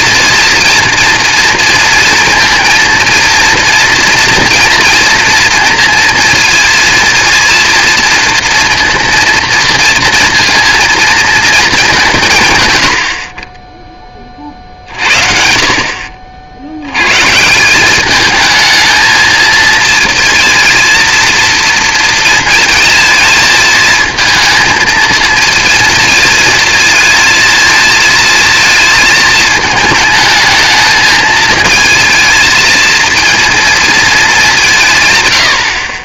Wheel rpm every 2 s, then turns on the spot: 230, 230, 230, 230, 230, 230, 140, 40, 70, 220, 230, 230, 220, 230, 230, 220, 220, 180.
none